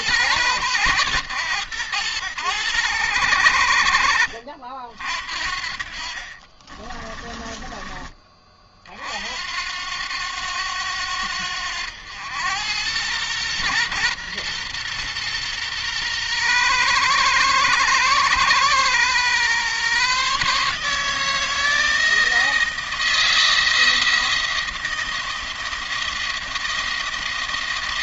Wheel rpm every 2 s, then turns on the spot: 110, 90, 70, 30, 40, 90, 100, 120, 120, 120, 150, 160, 160, 170.
6-8